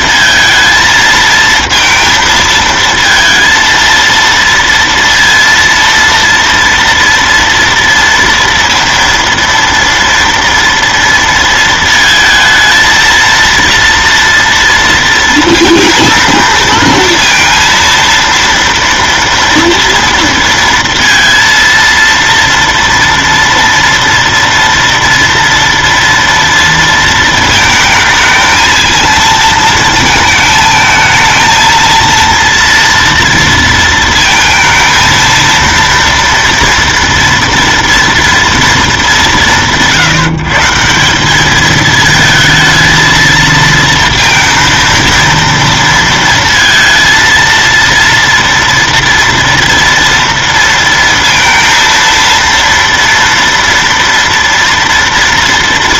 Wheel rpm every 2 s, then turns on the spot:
230, 230, 230, 230, 230, 230, 230, 230, 230, 230, 230, 230, 230, 230, 220, 220, 230, 230, 230, 230, 160, 220, 230, 230, 230, 230, 230, 230.
none